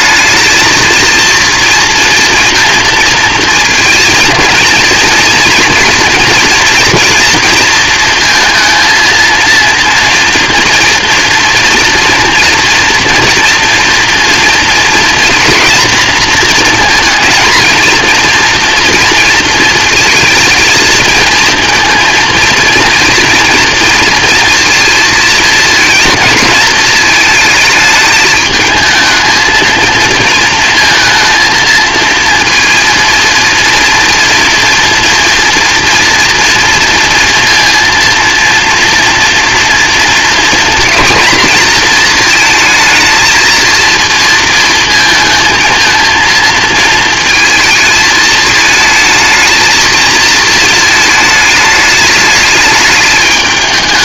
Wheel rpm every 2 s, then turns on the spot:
230, 230, 230, 230, 230, 230, 230, 230, 230, 230, 220, 230, 220, 220, 220, 230, 230, 230, 230, 230, 240, 220, 220, 220, 220, 220, 210.
none